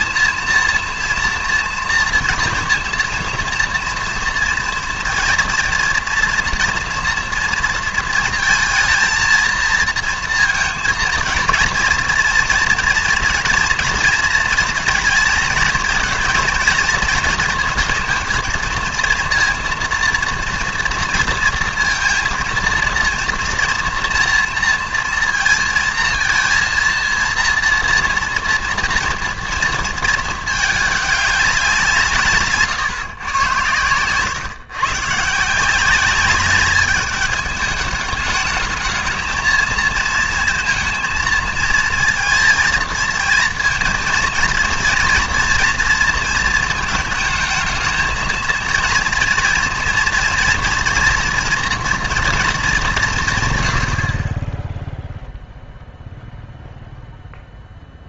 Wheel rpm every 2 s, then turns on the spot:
230, 230, 230, 240, 230, 230, 230, 230, 220, 230, 230, 230, 230, 230, 230, 210, 140, 120, 200, 210, 230, 230, 230, 220, 230, 240, 220, 10, 0.
none